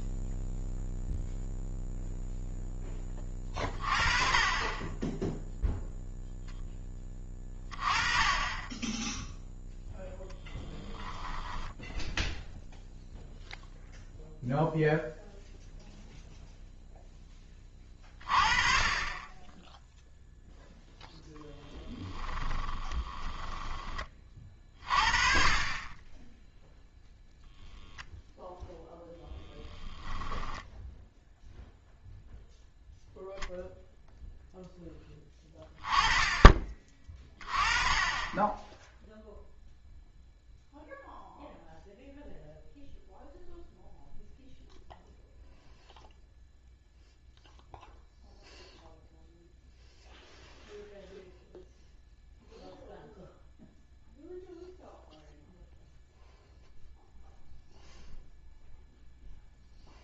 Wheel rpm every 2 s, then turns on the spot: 0, 10, 20, 10, 10, 10, 0, 0, 0, 20, 0, 10, 30, 0, 0, 10, 0, 0, 30, 10, 0, 0, 0, 0, 0, 0, 0, 0, 0, 0.
22-24 30-32